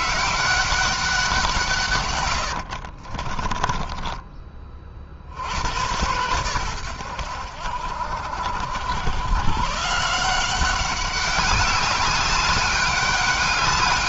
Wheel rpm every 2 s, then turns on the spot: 190, 60, 50, 90, 90, 190, 200.
2-4